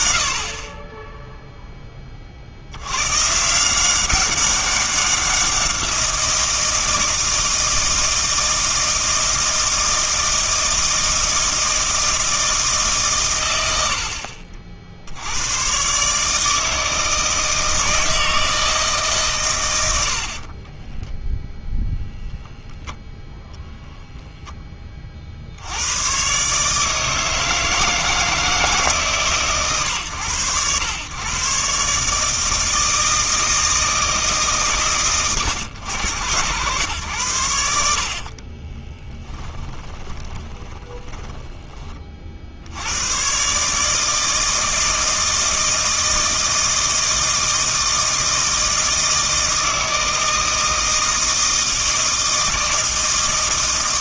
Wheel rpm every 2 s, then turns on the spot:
40, 70, 190, 170, 160, 160, 150, 50, 160, 160, 20, 0, 20, 150, 160, 120, 160, 130, 110, 30, 10, 80, 160, 160, 160, 160, 160.
20-22 38-42